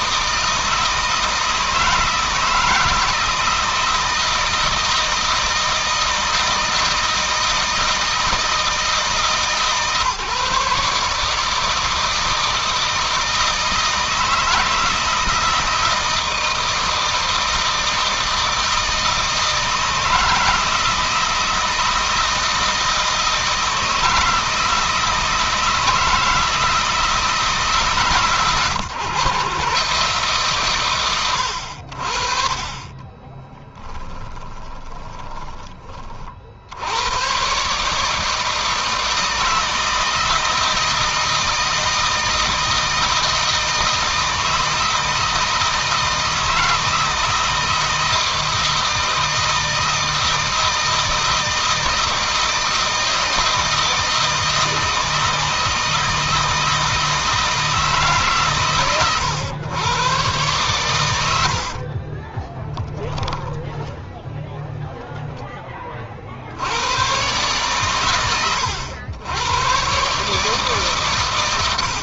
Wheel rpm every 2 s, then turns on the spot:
160, 160, 160, 160, 160, 150, 160, 160, 160, 160, 160, 160, 160, 160, 130, 130, 30, 30, 100, 160, 160, 160, 160, 160, 160, 160, 160, 160, 160, 120, 100, 10, 10, 110, 100, 130.
32-36 60-64